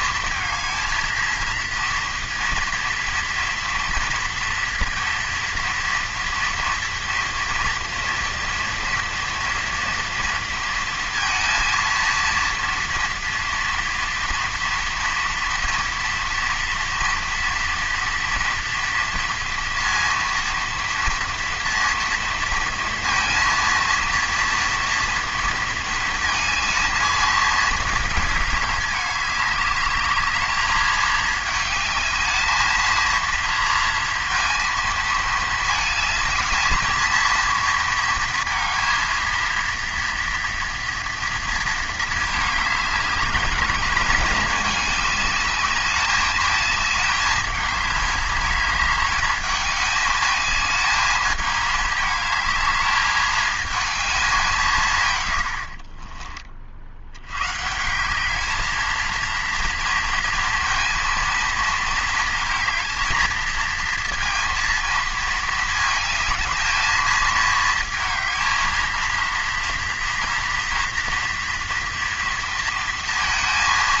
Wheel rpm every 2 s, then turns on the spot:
230, 230, 230, 230, 230, 230, 230, 230, 230, 230, 230, 230, 230, 230, 210, 210, 220, 230, 220, 230, 230, 200, 200, 220, 210, 220, 220, 180, 50, 220, 230, 230, 230, 220, 230, 230, 230.
none